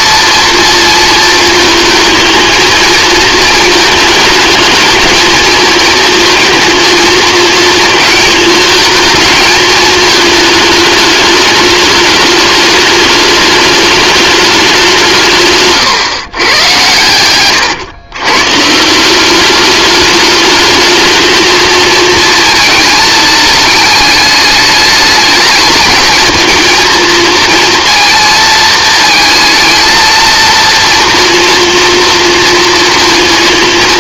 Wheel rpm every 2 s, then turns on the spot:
230, 220, 220, 230, 220, 210, 210, 190, 110, 150, 220, 220, 210, 220, 230, 230, 230.
none